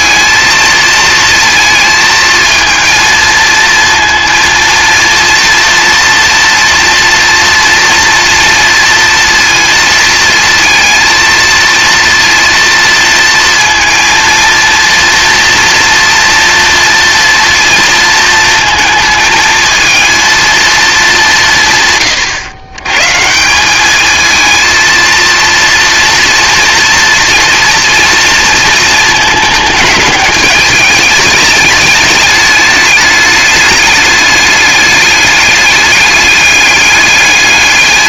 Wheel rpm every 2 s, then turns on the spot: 220, 220, 230, 230, 230, 230, 230, 230, 230, 230, 230, 110, 230, 240, 220, 210, 210, 210, 210.
none